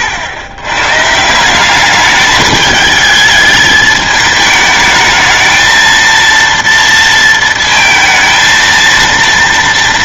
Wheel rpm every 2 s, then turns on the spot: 90, 210, 220, 230, 230.
none